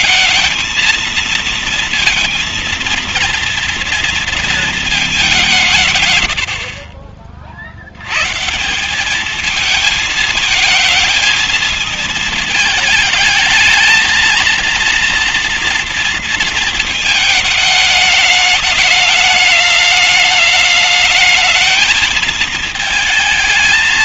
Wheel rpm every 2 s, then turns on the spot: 220, 230, 230, 70, 140, 220, 220, 230, 230, 210, 210, 220.
none